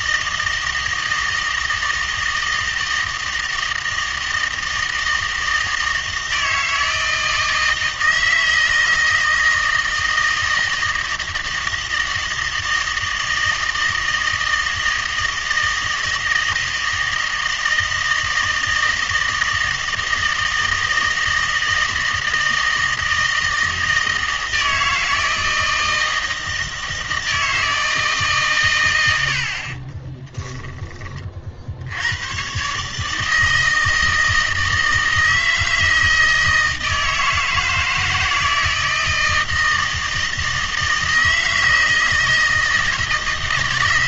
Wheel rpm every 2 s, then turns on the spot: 160, 160, 160, 160, 160, 160, 160, 160, 160, 160, 160, 160, 160, 160, 120, 20, 140, 160, 160, 160, 160, 160.
none